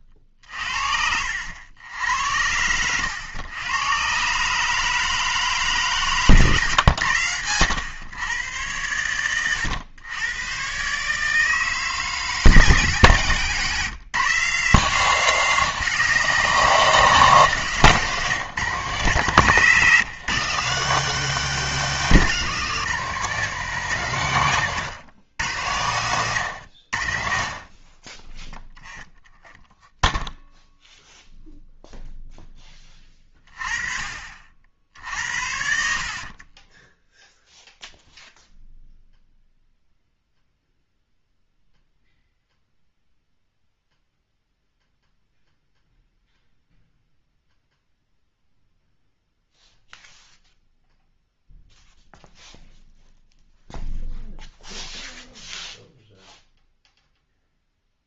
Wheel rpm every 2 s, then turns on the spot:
50, 80, 150, 140, 110, 120, 150, 160, 170, 140, 160, 170, 130, 100, 0, 0, 10, 50, 20, 0, 0, 0, 0, 0, 0, 0, 0, 0, 0.
0-2 6-8 24-26 36-38